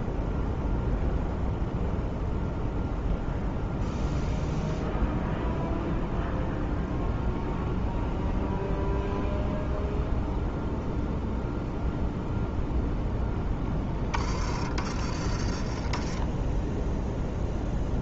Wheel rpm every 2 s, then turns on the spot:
0, 0, 0, 0, 0, 0, 0, 30, 10.
14-16